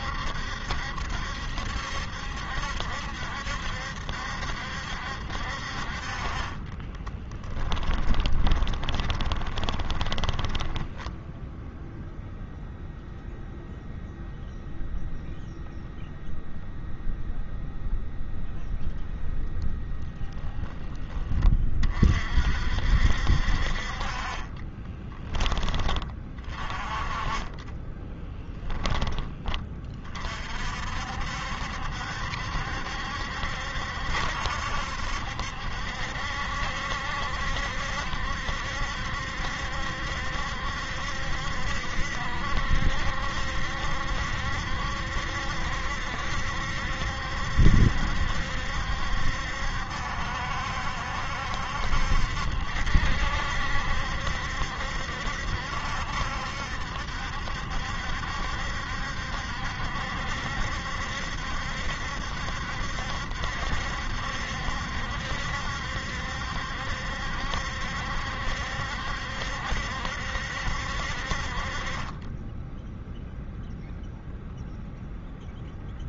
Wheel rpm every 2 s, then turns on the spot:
70, 70, 60, 20, 20, 10, 0, 0, 0, 0, 30, 60, 20, 30, 10, 60, 70, 70, 70, 70, 70, 70, 70, 70, 70, 70, 70, 70, 70, 70, 70, 70, 70, 70, 70, 60, 10, 0.
6-12 24-26